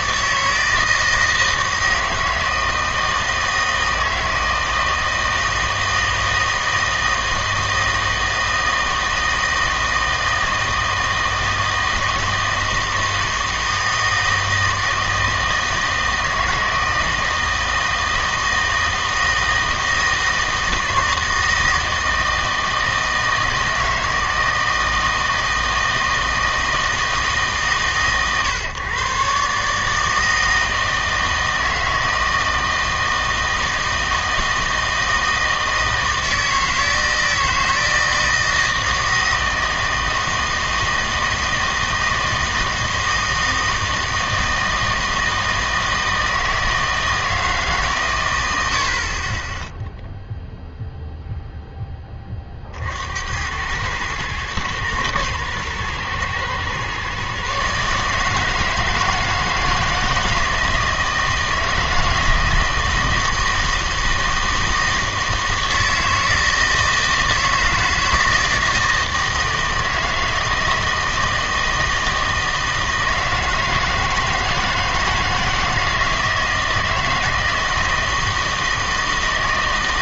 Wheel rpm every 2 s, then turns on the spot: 160, 160, 160, 160, 160, 160, 160, 160, 160, 160, 160, 160, 160, 160, 130, 160, 160, 160, 160, 160, 160, 160, 160, 160, 80, 0, 40, 110, 120, 160, 160, 160, 160, 160, 160, 160, 160, 160, 160, 160.
none